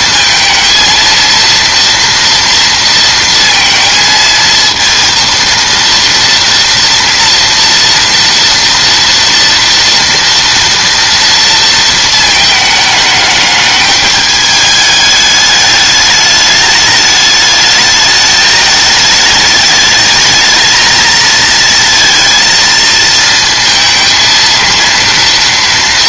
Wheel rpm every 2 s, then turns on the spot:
230, 230, 230, 230, 230, 230, 210, 210, 210, 210, 220, 230, 230.
none